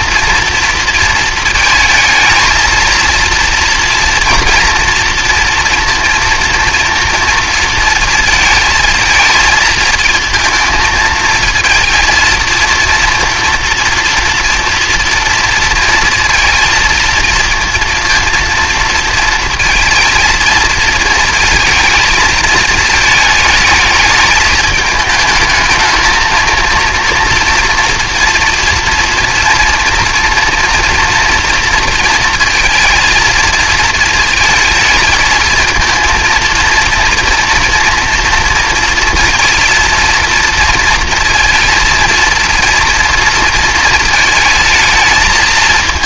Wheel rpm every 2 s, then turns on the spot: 230, 220, 230, 230, 220, 230, 230, 230, 230, 230, 220, 220, 220, 230, 230, 230, 230, 220, 230, 230, 230, 230, 220.
none